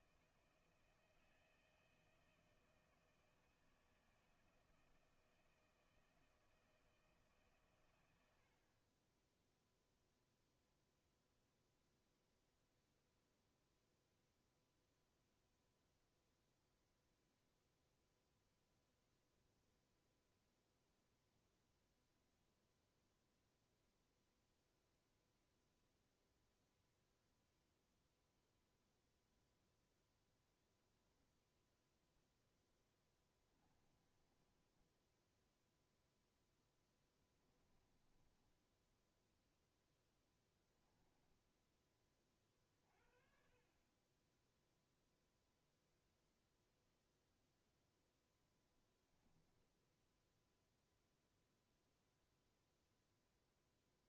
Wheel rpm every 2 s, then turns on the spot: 160, 160, 160, 160, 70, 0, 0, 0, 0, 0, 0, 0, 0, 0, 0, 0, 10, 10, 0, 10, 10, 30, 10, 0, 0, 0, 0.
34-36 38-42